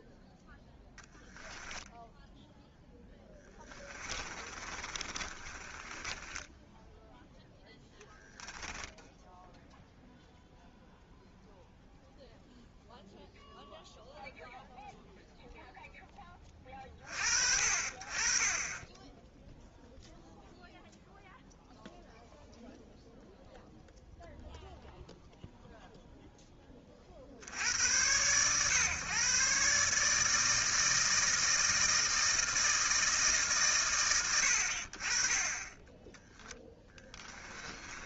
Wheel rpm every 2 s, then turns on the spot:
10, 10, 30, 10, 0, 0, 0, 0, 20, 20, 0, 0, 0, 20, 120, 160, 160, 80, 10.
0-8 36-38